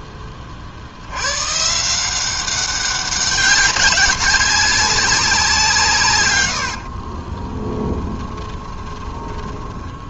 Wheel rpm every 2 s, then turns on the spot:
70, 190, 190, 70, 20.
6-10